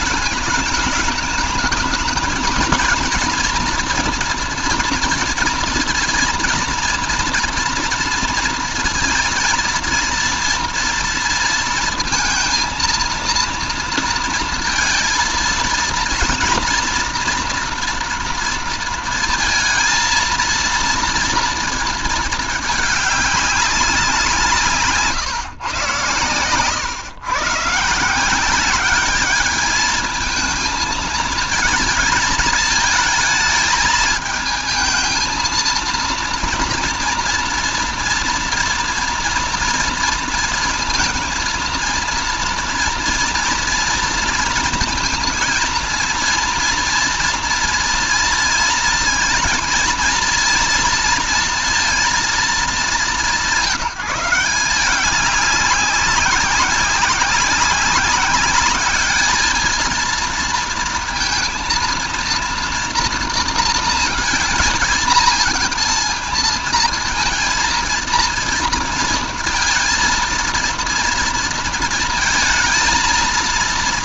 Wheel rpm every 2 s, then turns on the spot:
210, 230, 230, 230, 230, 230, 230, 230, 230, 230, 230, 210, 150, 110, 210, 230, 220, 220, 240, 240, 230, 230, 230, 230, 230, 230, 200, 190, 190, 210, 230, 230, 220, 220, 230, 230, 230.
none